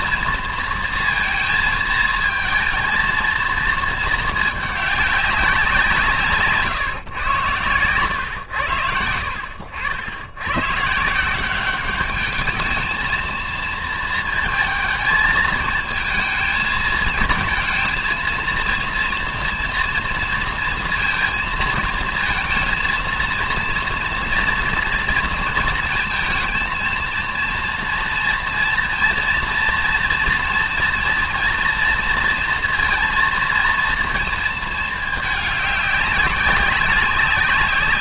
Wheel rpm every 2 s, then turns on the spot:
230, 220, 210, 150, 110, 110, 210, 220, 220, 230, 230, 230, 230, 230, 230, 240, 230, 220, 190.
none